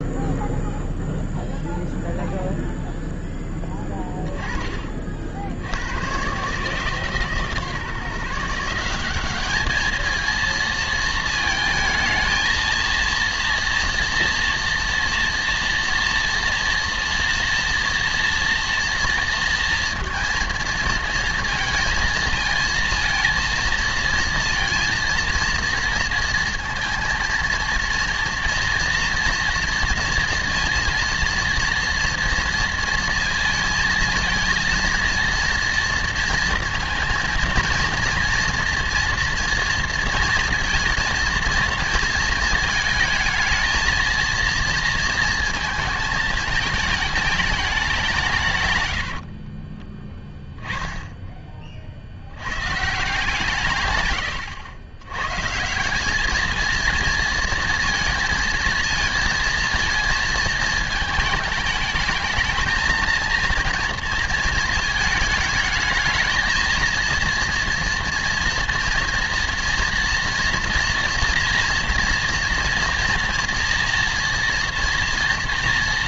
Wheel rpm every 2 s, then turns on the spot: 0, 0, 30, 140, 170, 230, 230, 230, 230, 240, 230, 230, 230, 230, 230, 230, 230, 230, 230, 240, 230, 220, 230, 220, 140, 10, 130, 100, 220, 230, 220, 220, 230, 220, 230, 240, 230, 230.
none